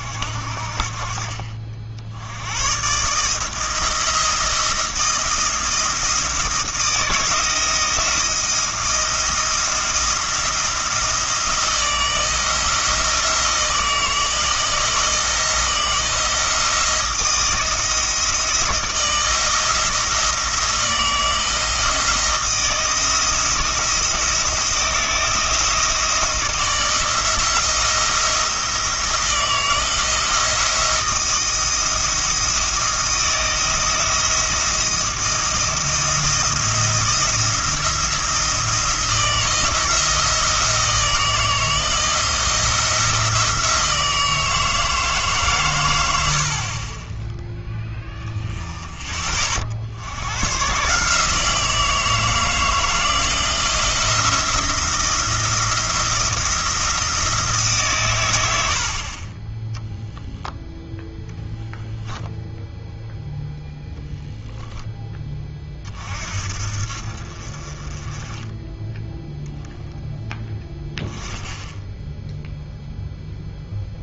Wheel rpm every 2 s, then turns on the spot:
50, 120, 160, 160, 170, 170, 160, 170, 170, 160, 160, 160, 170, 170, 160, 170, 170, 170, 170, 170, 160, 170, 160, 30, 20, 140, 160, 170, 160, 60, 0, 0, 10, 60, 10, 10, 0.
none